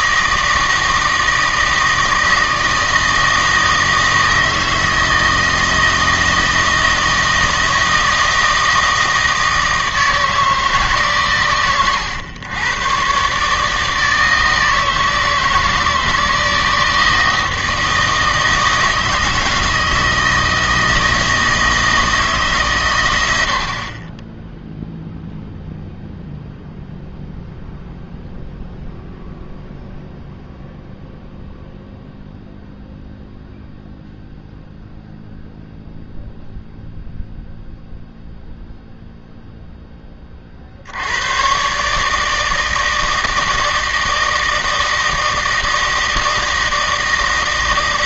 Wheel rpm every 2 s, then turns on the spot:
160, 160, 160, 160, 160, 150, 110, 160, 160, 160, 160, 140, 0, 0, 0, 0, 0, 0, 0, 0, 50, 160, 160, 160.
none